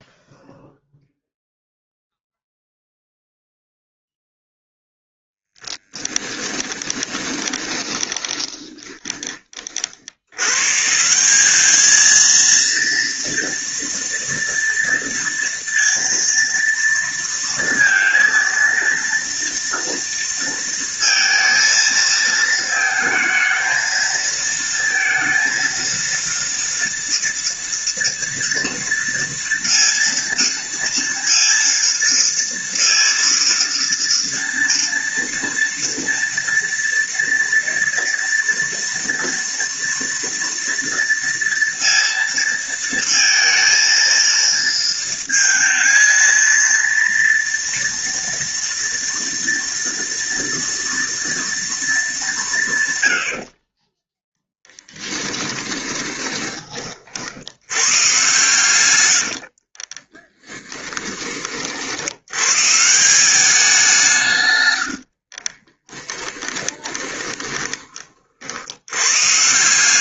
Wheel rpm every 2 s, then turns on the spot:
0, 0, 0, 10, 20, 150, 230, 230, 230, 230, 230, 220, 230, 230, 230, 230, 230, 230, 230, 230, 230, 220, 230, 230, 230, 230, 130, 10, 40, 100, 10, 160, 80, 20, 90.
6-10 54-56 58-60 64-68